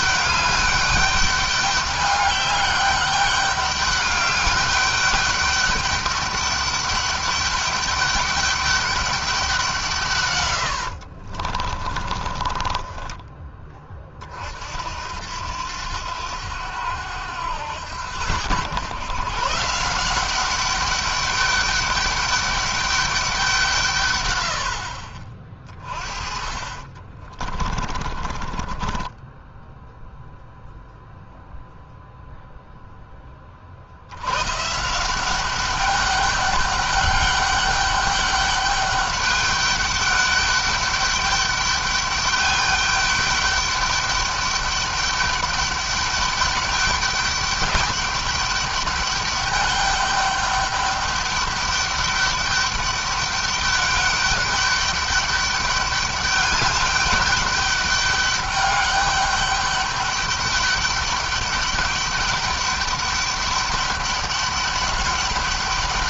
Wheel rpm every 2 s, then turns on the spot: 200, 200, 200, 200, 200, 90, 20, 60, 90, 110, 200, 200, 60, 30, 20, 0, 0, 160, 200, 200, 200, 210, 200, 200, 200, 200, 200, 200, 200, 200, 200, 200, 200.
10-14 26-30